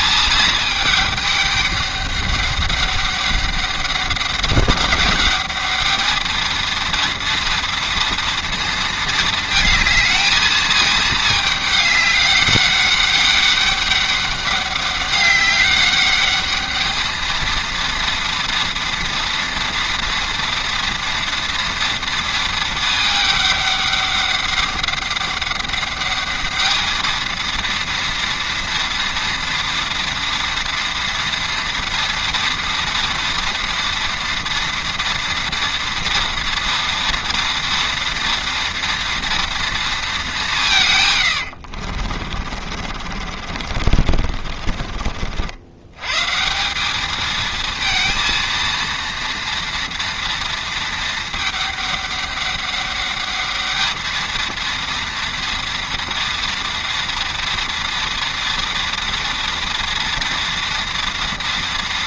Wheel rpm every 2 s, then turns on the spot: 220, 200, 200, 220, 230, 220, 200, 200, 210, 230, 230, 220, 200, 210, 230, 240, 230, 230, 230, 230, 170, 40, 50, 180, 230, 230, 200, 230, 230, 230, 230.
42-46